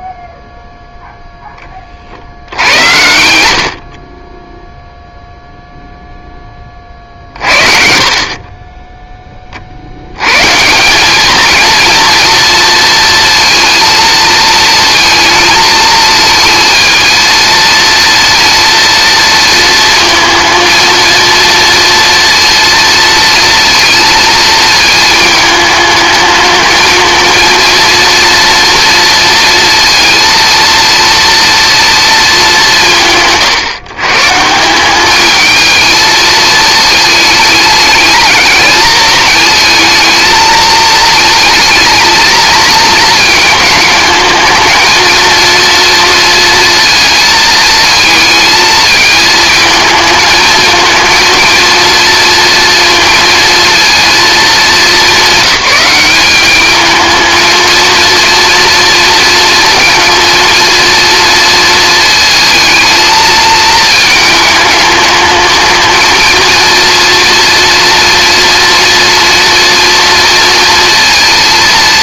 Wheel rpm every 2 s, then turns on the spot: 0, 80, 0, 30, 10, 180, 230, 230, 220, 230, 230, 230, 220, 220, 230, 230, 150, 190, 220, 220, 220, 230, 230, 230, 220, 230, 230, 200, 220, 230, 230, 220, 210, 230, 230, 230.
none